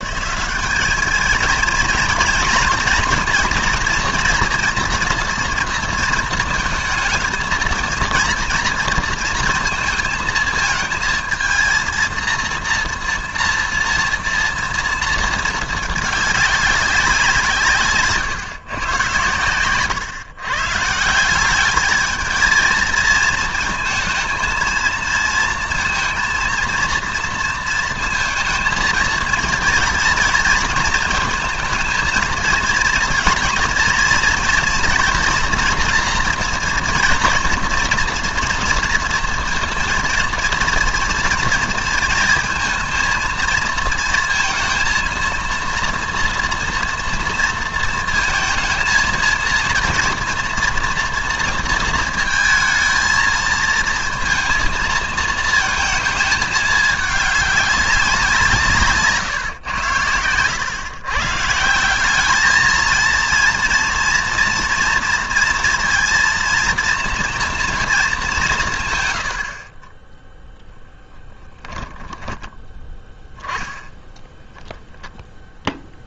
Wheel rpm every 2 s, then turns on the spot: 200, 240, 230, 220, 230, 220, 230, 230, 200, 130, 150, 230, 230, 230, 230, 230, 230, 230, 240, 230, 230, 220, 230, 240, 230, 230, 220, 220, 210, 150, 120, 220, 240, 230, 160, 10, 20, 0.
70-72